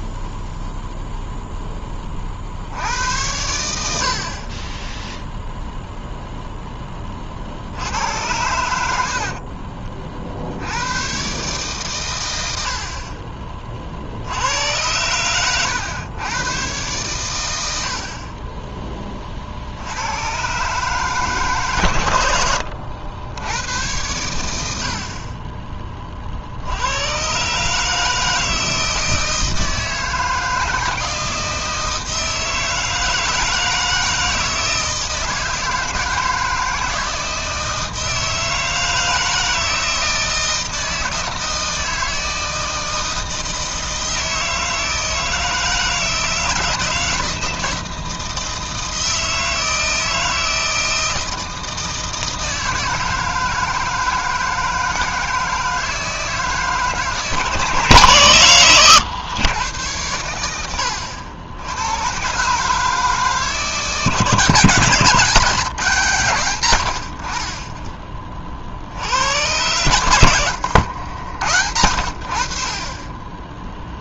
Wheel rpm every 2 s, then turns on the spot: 0, 60, 30, 0, 100, 70, 90, 90, 120, 20, 130, 90, 80, 70, 160, 170, 160, 160, 160, 160, 160, 160, 160, 160, 160, 160, 160, 160, 160, 120, 90, 140, 150, 110, 40, 100, 80.
70-72